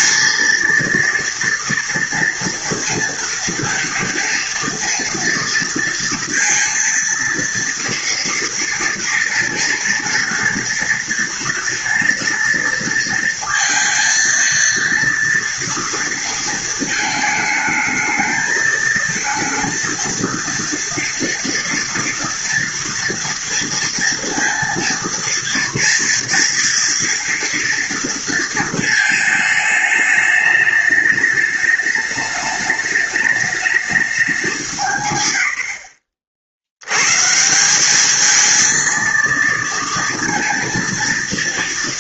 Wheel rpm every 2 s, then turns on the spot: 230, 230, 230, 230, 230, 230, 230, 230, 220, 220, 230, 230, 230, 230, 220, 210, 210, 170, 100, 230, 230.
none